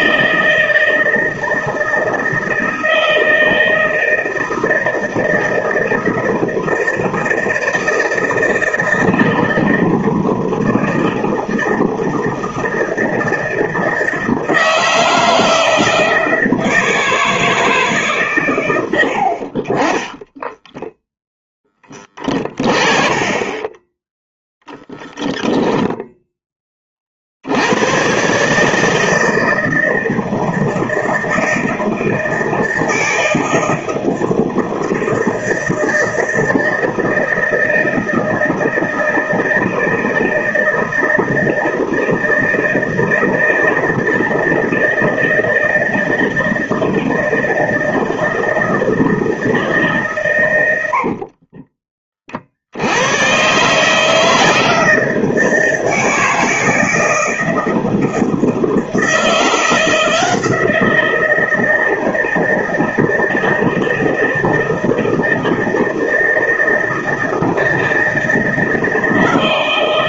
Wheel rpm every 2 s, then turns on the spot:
160, 160, 160, 160, 160, 160, 160, 160, 160, 110, 10, 20, 0, 30, 150, 160, 160, 160, 160, 160, 160, 160, 160, 160, 160, 80, 70, 160, 160, 160, 170, 160, 160, 160, 160.
20-22 50-52